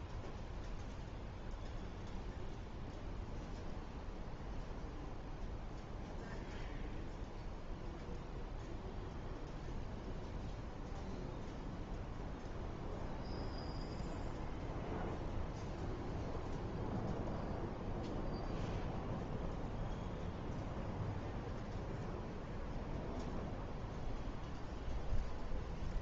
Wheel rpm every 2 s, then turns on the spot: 0, 0, 0, 0, 0, 0, 0, 0, 0, 0, 0, 0, 0.
none